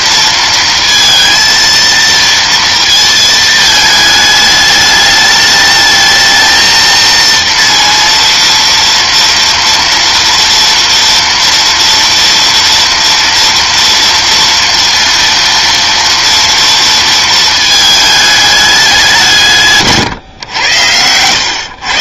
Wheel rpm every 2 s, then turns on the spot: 230, 230, 210, 230, 230, 230, 240, 230, 230, 200, 100.
none